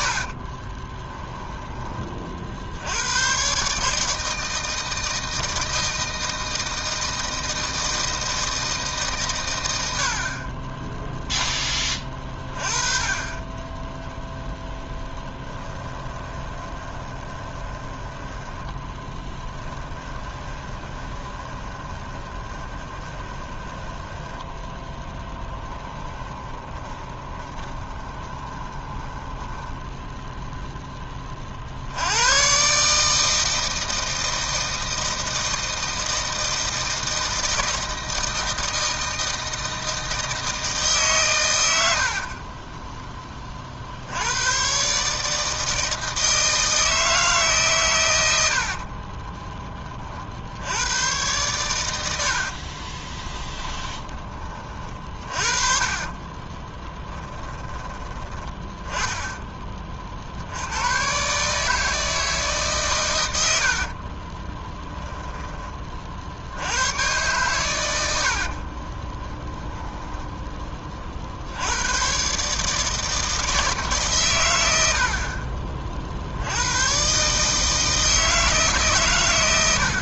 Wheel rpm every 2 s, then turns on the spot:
20, 70, 160, 160, 160, 20, 30, 0, 20, 10, 20, 20, 10, 20, 20, 0, 140, 160, 160, 160, 150, 20, 130, 160, 60, 90, 40, 40, 20, 10, 90, 140, 10, 90, 30, 20, 150, 80, 120, 140.
0-2 16-30 42-44 48-50 52-54 56-58 68-70